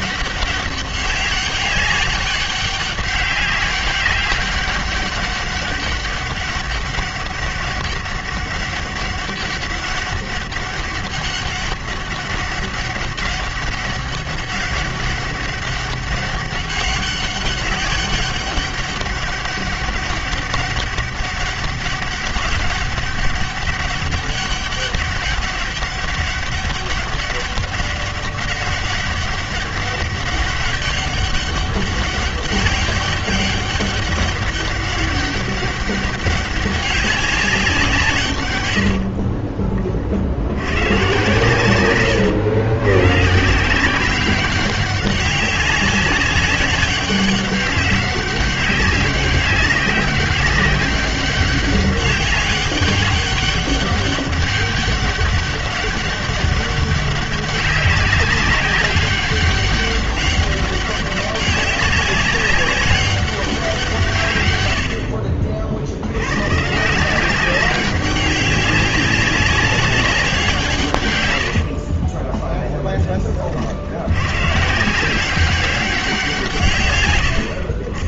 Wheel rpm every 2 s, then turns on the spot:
200, 200, 200, 200, 200, 200, 200, 200, 200, 200, 200, 200, 200, 190, 200, 200, 200, 200, 200, 70, 120, 130, 190, 200, 200, 200, 200, 200, 190, 200, 200, 200, 80, 160, 190, 130, 10, 160, 120.
38-40